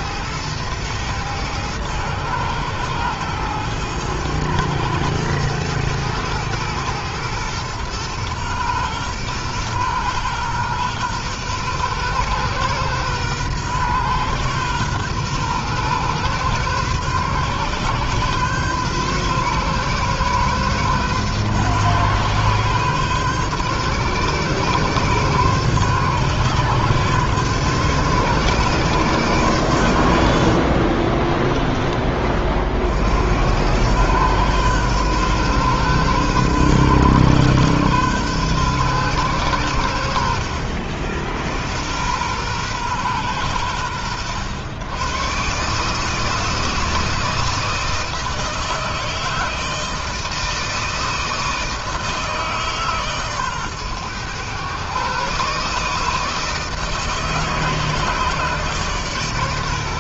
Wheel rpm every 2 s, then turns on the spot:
110, 110, 110, 110, 120, 120, 120, 120, 130, 140, 130, 130, 130, 140, 140, 50, 50, 120, 130, 130, 70, 120, 110, 160, 160, 160, 150, 120, 160, 150.
30-32